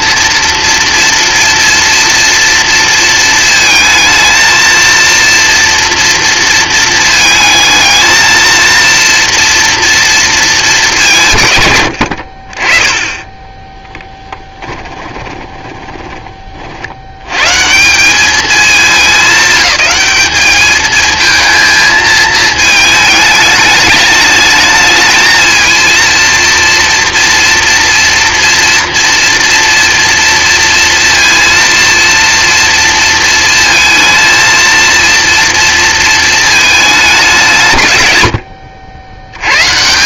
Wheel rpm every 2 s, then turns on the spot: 230, 230, 230, 230, 230, 200, 30, 20, 50, 210, 210, 220, 210, 230, 240, 230, 230, 230, 210, 80.
14-16